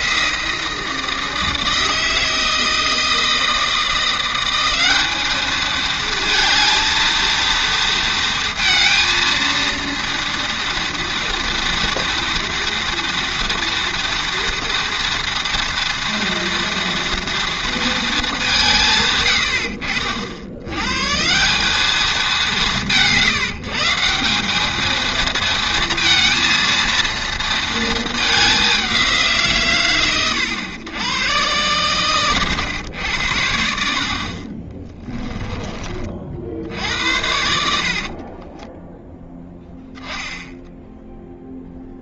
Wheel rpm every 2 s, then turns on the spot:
170, 160, 190, 220, 230, 230, 230, 230, 230, 180, 80, 160, 200, 230, 220, 100, 120, 40, 60, 20, 0.
38-40